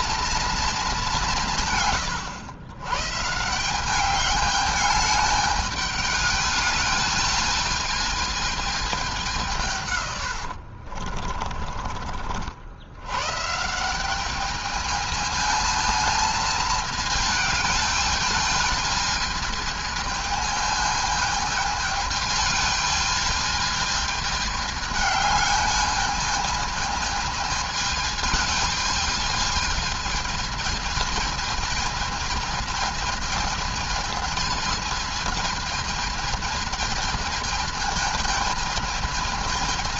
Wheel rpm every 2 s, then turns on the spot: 220, 120, 210, 210, 210, 70, 70, 210, 220, 210, 220, 220, 210, 220, 220, 220, 220, 220, 220, 220.
10-12